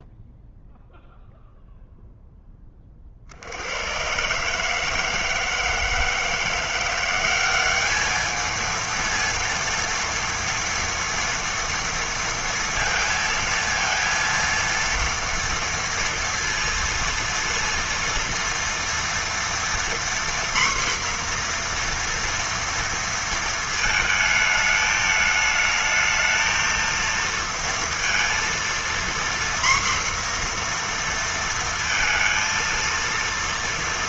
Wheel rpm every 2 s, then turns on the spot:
0, 10, 140, 170, 220, 230, 230, 230, 230, 230, 240, 230, 220, 220, 230, 240, 230.
none